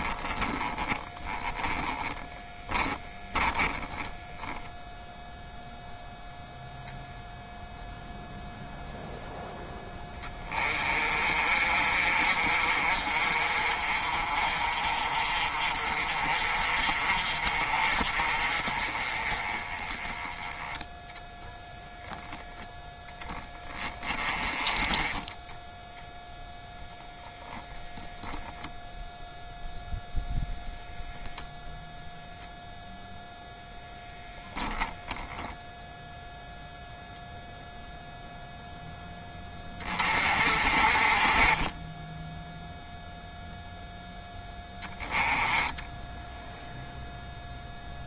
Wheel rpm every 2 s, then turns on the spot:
10, 10, 0, 0, 0, 30, 40, 40, 40, 30, 10, 10, 10, 10, 0, 0, 0, 0, 0, 0, 30, 0, 10, 0.
0-4